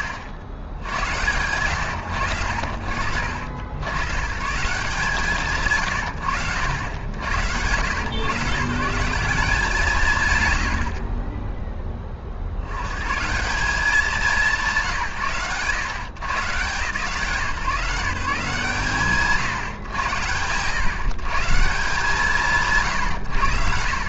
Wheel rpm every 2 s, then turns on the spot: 70, 60, 150, 80, 160, 70, 130, 150, 140, 140, 130, 130.
none